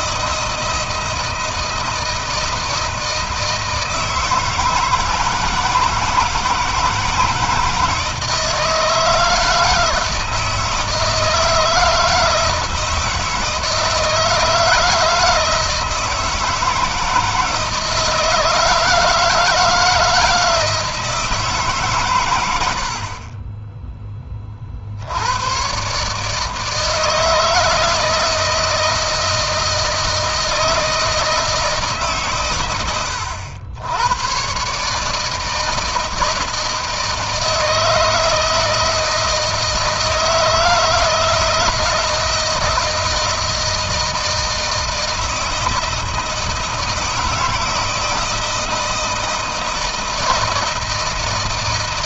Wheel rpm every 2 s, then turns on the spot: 160, 160, 160, 160, 160, 160, 160, 160, 160, 160, 160, 110, 20, 150, 160, 160, 130, 110, 160, 160, 160, 160, 160, 160, 160, 160.
none